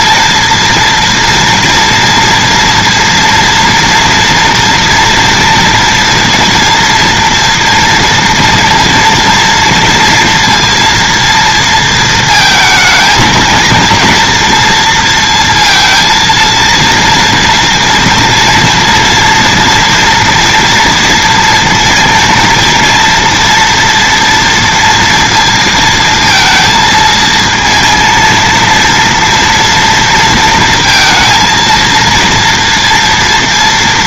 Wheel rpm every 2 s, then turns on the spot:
230, 230, 230, 230, 230, 230, 220, 230, 230, 230, 230, 230, 230, 230, 230, 230, 230.
none